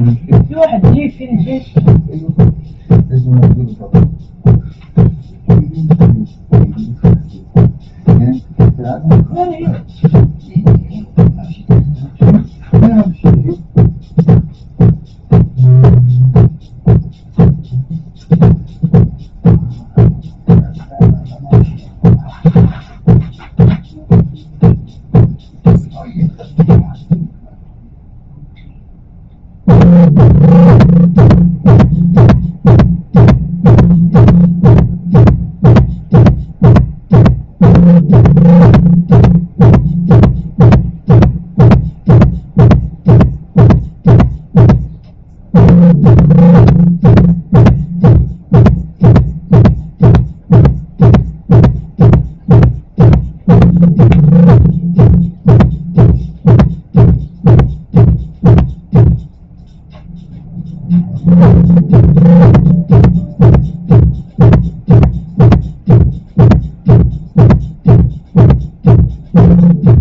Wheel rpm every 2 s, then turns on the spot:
0, 0, 0, 0, 0, 0, 0, 0, 0, 0, 0, 0, 0, 0, 0, 0, 0, 0, 0, 0, 0, 0, 0, 0, 0, 0, 0, 0, 0, 0, 0, 0, 0, 0, 0.
none